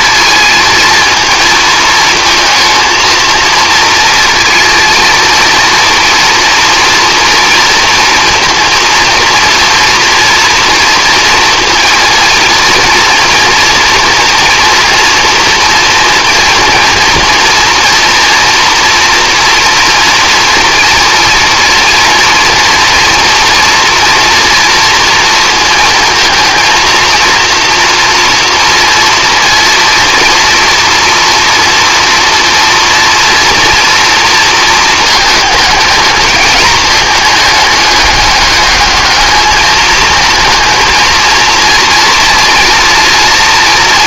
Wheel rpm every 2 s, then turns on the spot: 220, 230, 230, 230, 230, 230, 230, 240, 230, 230, 230, 230, 230, 230, 230, 230, 230, 220, 220, 210, 220, 230.
none